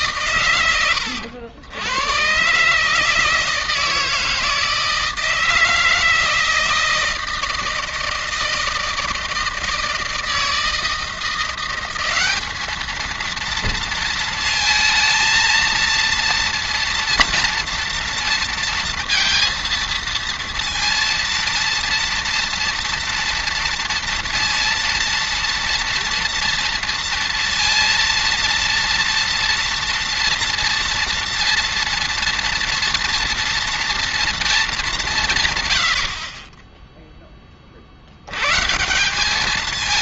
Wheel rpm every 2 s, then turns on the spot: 120, 130, 160, 160, 160, 160, 200, 230, 230, 230, 230, 230, 230, 230, 230, 230, 230, 230, 40, 110.
none